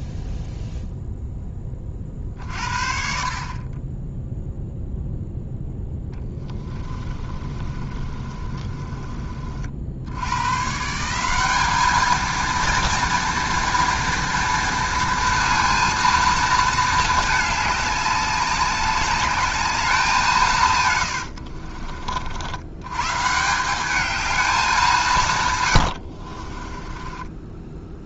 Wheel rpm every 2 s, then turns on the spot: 0, 50, 0, 20, 30, 150, 230, 230, 220, 200, 130, 110, 190, 30.
6-10 26-28